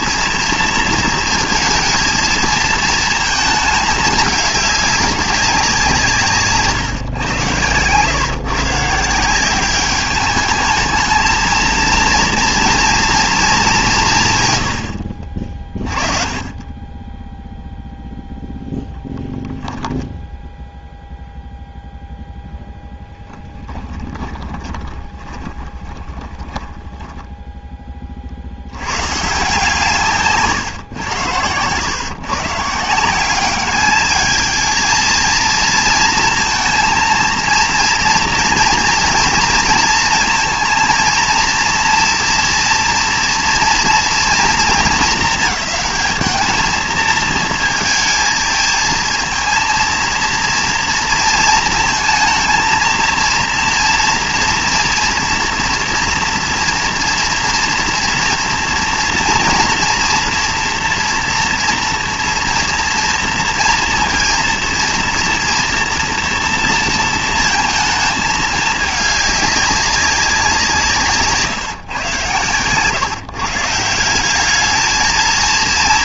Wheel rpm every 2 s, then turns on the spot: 230, 230, 200, 140, 140, 210, 230, 110, 20, 10, 10, 0, 20, 10, 80, 130, 150, 220, 230, 240, 230, 230, 230, 220, 230, 230, 230, 230, 230, 230, 230, 240, 230, 230, 220, 180, 120, 210.
24-28